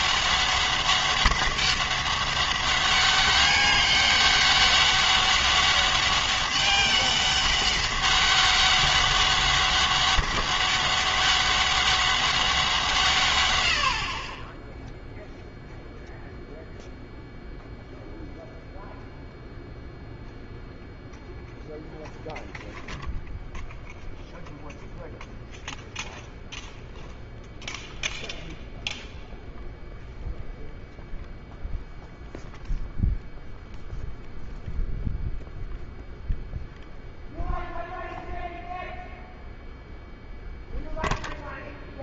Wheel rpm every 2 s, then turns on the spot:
200, 200, 200, 200, 200, 200, 180, 10, 0, 0, 0, 0, 0, 0, 0, 0, 0, 0, 0, 0, 0.
none